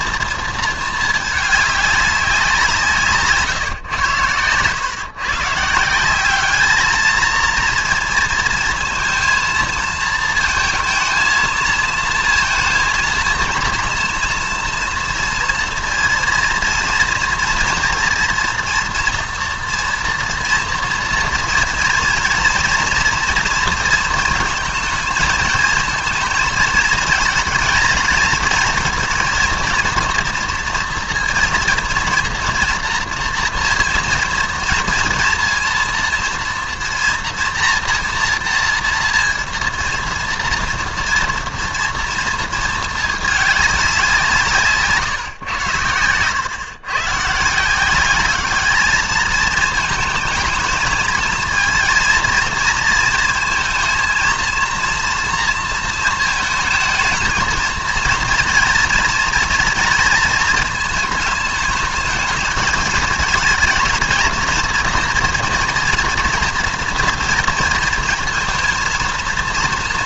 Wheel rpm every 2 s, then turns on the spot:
230, 170, 110, 210, 230, 230, 230, 230, 230, 230, 230, 230, 230, 220, 220, 230, 230, 230, 230, 230, 230, 220, 160, 120, 210, 220, 230, 230, 220, 230, 220, 220, 230, 230, 230.
none